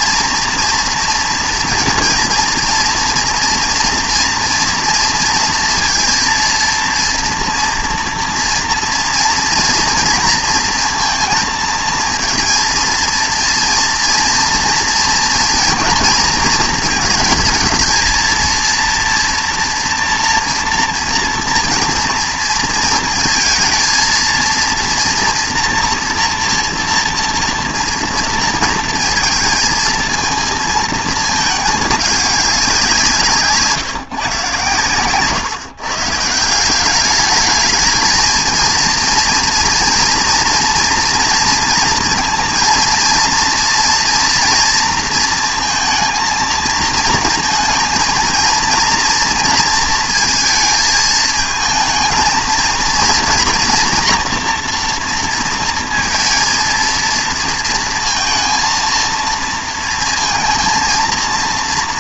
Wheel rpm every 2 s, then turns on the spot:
230, 230, 230, 230, 230, 230, 230, 230, 230, 230, 240, 230, 230, 230, 230, 220, 200, 140, 170, 230, 230, 230, 230, 230, 230, 230, 230, 240, 230, 230, 230.
none